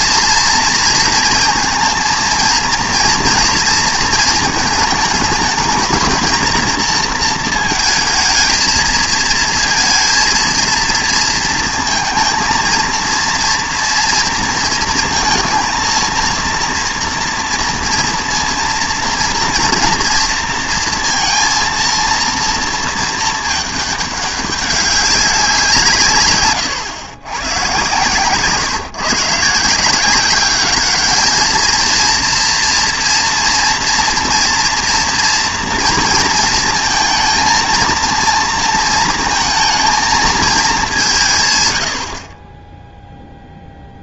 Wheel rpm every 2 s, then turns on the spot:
230, 230, 220, 230, 220, 230, 220, 230, 230, 230, 230, 230, 200, 110, 140, 200, 230, 230, 230, 230, 210, 20.
none